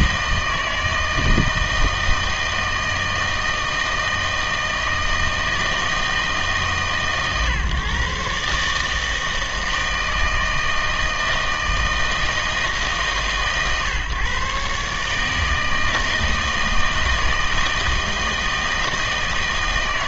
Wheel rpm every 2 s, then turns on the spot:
160, 160, 160, 150, 150, 160, 160, 140, 160, 160.
none